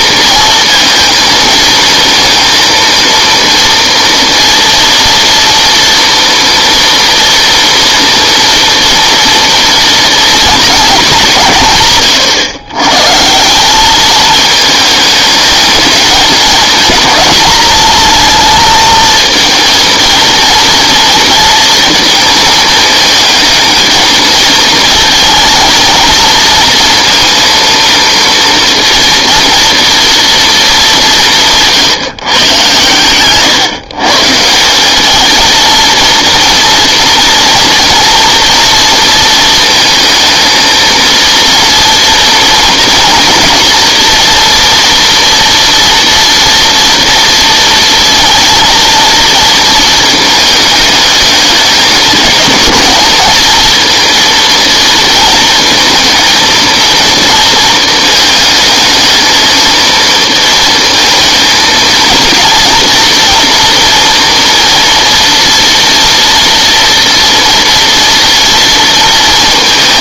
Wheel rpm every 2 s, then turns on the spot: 230, 230, 230, 230, 230, 230, 120, 210, 220, 220, 230, 220, 230, 230, 230, 220, 130, 180, 230, 230, 230, 240, 240, 230, 230, 210, 220, 230, 220, 220, 230, 230, 230, 230, 230.
none